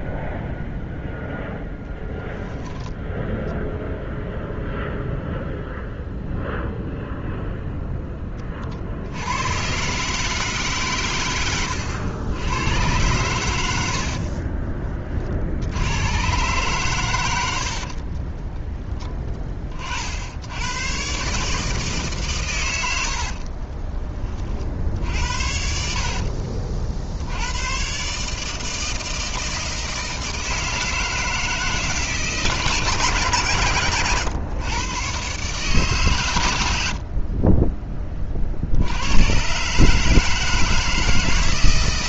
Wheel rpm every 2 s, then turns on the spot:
0, 10, 0, 0, 50, 150, 110, 40, 130, 10, 100, 110, 50, 60, 160, 160, 160, 120, 80, 70, 160.
none